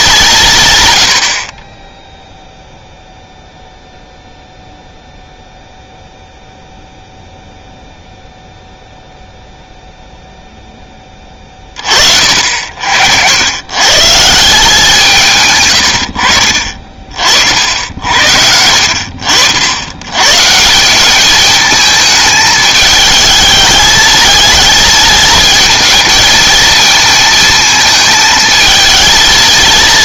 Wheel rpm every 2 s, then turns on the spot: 140, 0, 0, 0, 0, 10, 60, 180, 50, 70, 170, 220, 220, 220, 220.
none